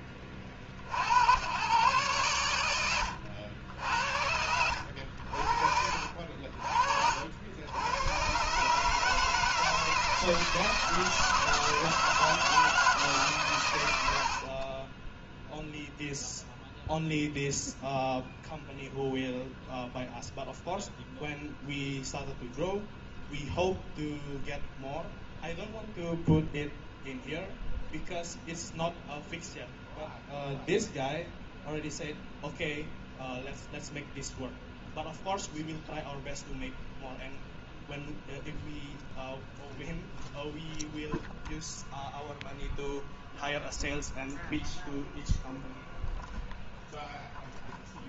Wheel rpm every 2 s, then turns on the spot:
50, 110, 80, 50, 140, 160, 160, 40, 0, 0, 0, 0, 0, 0, 0, 0, 0, 0, 0, 0, 0, 0, 0, 0.
none